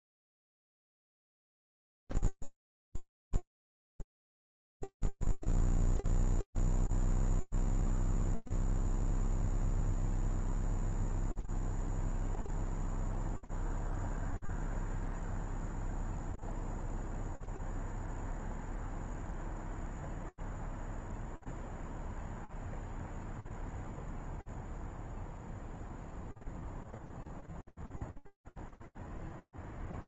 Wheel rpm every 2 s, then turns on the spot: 0, 0, 0, 0, 0, 0, 0, 0, 0, 0, 0, 0, 0, 0, 0.
none